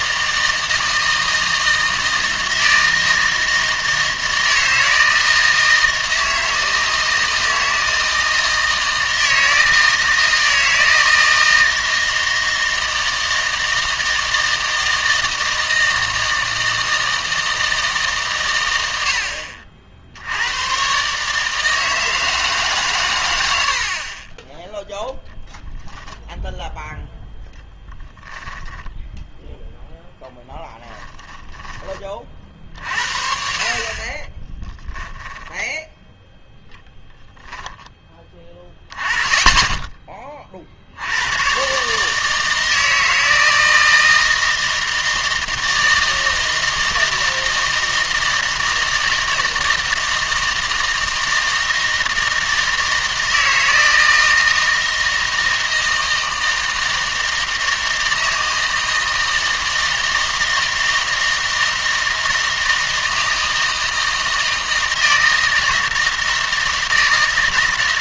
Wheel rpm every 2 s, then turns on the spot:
160, 160, 160, 160, 160, 160, 160, 160, 160, 80, 110, 140, 10, 0, 10, 10, 50, 10, 0, 10, 40, 160, 160, 160, 160, 160, 160, 160, 160, 160, 160, 160, 160, 160.
34-36